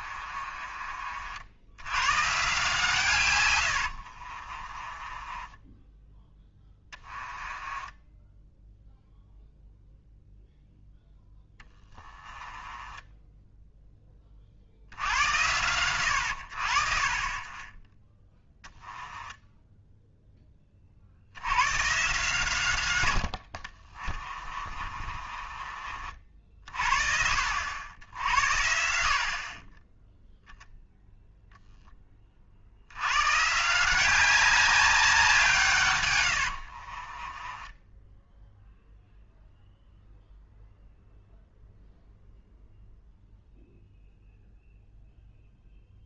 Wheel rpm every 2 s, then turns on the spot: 40, 150, 30, 10, 0, 0, 10, 60, 60, 10, 20, 120, 30, 50, 70, 0, 60, 200, 60, 0, 0, 0, 0.
0-2 4-8 12-14 18-20 24-26 36-38